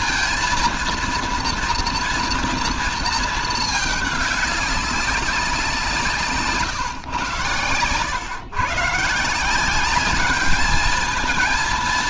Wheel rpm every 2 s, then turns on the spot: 230, 230, 200, 140, 150, 220.
none